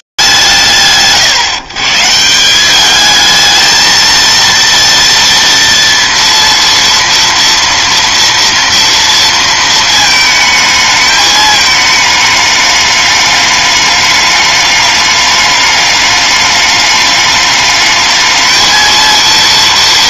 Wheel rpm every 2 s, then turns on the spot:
120, 210, 230, 230, 230, 220, 210, 210, 210, 220.
none